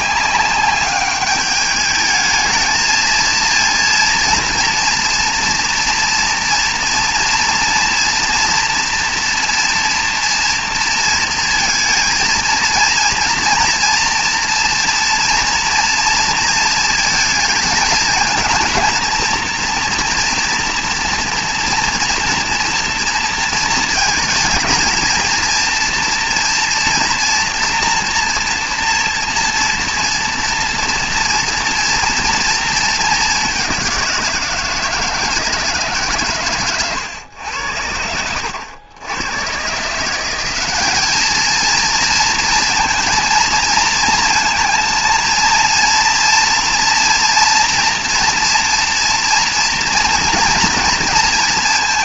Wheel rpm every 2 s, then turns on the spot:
200, 220, 230, 230, 240, 230, 230, 230, 230, 230, 230, 230, 220, 240, 240, 230, 230, 170, 120, 80, 200, 230, 230, 240, 230, 240.
none